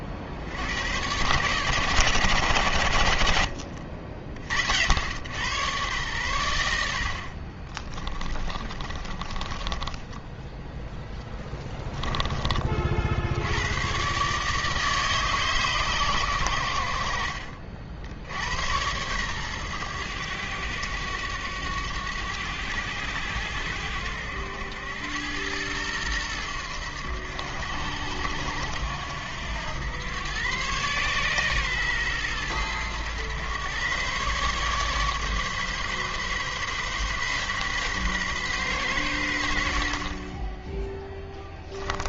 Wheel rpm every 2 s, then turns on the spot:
100, 80, 80, 70, 30, 0, 60, 150, 80, 100, 100, 90, 90, 90, 80, 130, 100, 140, 140, 120, 10.
6-10